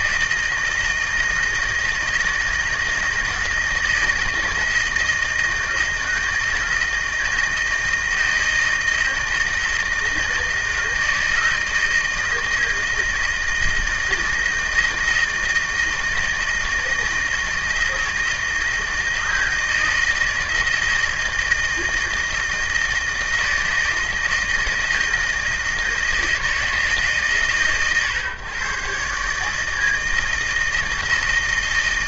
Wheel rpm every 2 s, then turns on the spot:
160, 160, 160, 160, 160, 160, 160, 160, 160, 160, 160, 160, 160, 160, 120, 160.
none